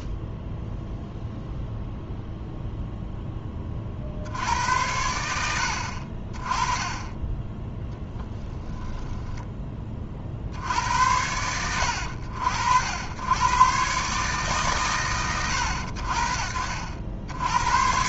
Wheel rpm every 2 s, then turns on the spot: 0, 0, 90, 20, 0, 80, 80, 120, 60.
none